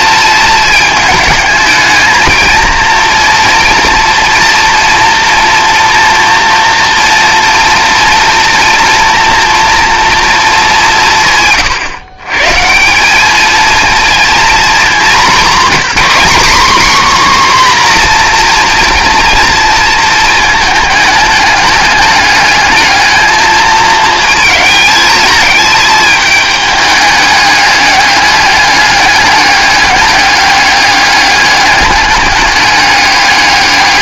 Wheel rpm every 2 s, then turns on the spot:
220, 220, 230, 230, 230, 200, 160, 220, 250, 230, 220, 210, 220, 210, 200, 200, 200.
none